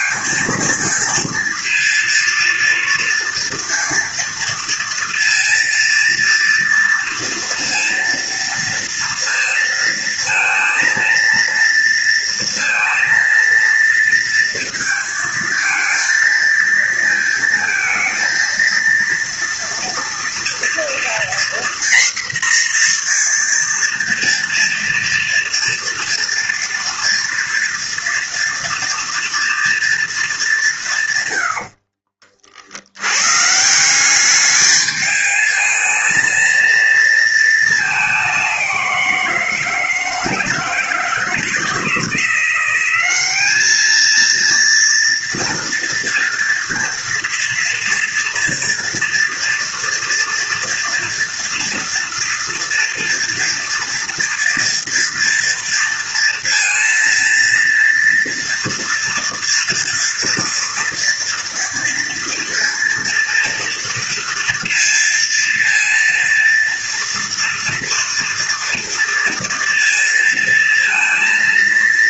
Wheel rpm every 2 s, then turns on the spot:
230, 230, 230, 230, 230, 230, 230, 230, 220, 230, 240, 240, 230, 230, 230, 180, 70, 210, 230, 190, 160, 190, 230, 230, 230, 240, 240, 230, 230, 230, 230, 230, 230, 230, 230, 230.
none